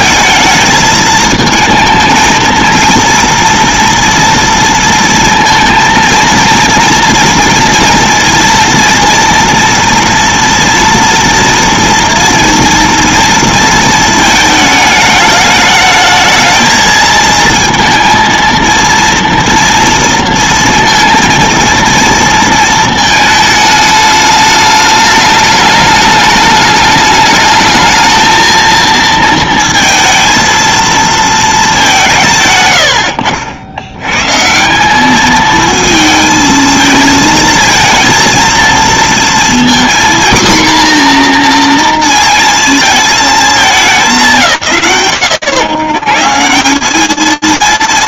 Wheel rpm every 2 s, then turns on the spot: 220, 230, 230, 230, 230, 230, 230, 220, 220, 230, 230, 230, 210, 210, 230, 230, 130, 150, 220, 230, 250, 220, 150, 150.
none